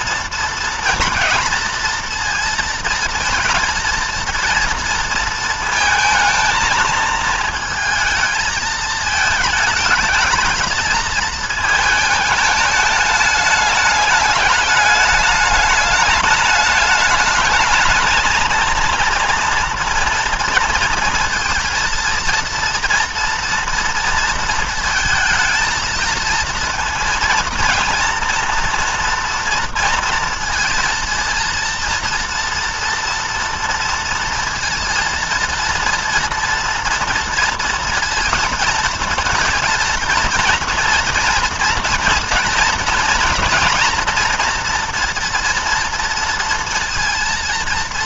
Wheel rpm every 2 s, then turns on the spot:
230, 230, 230, 220, 220, 220, 210, 210, 210, 230, 230, 230, 230, 230, 230, 230, 230, 230, 230, 230, 230, 230, 230, 230.
none